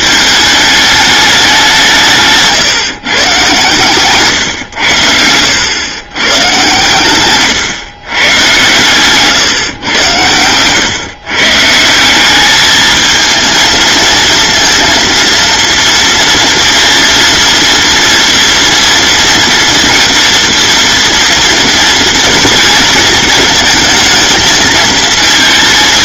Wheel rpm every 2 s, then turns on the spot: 210, 140, 100, 120, 110, 120, 220, 230, 230, 240, 230, 230, 220.
none